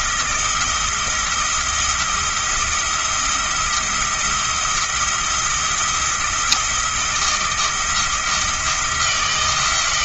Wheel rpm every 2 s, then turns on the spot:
170, 170, 170, 160, 170.
none